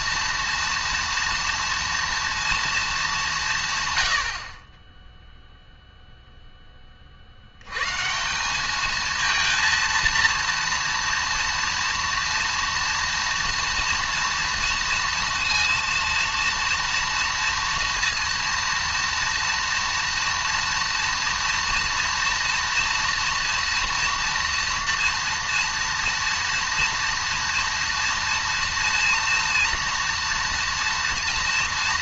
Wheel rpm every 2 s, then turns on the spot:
230, 230, 40, 10, 200, 230, 240, 230, 230, 230, 230, 230, 230, 230, 230, 230.
none